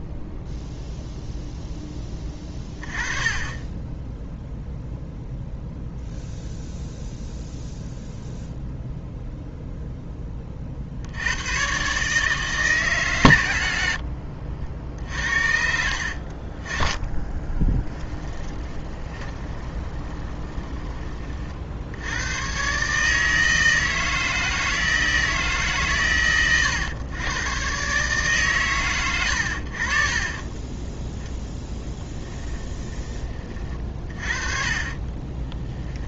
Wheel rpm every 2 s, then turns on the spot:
0, 30, 0, 0, 0, 40, 150, 60, 40, 10, 20, 130, 160, 120, 130, 20, 10, 30.
18-22 34-36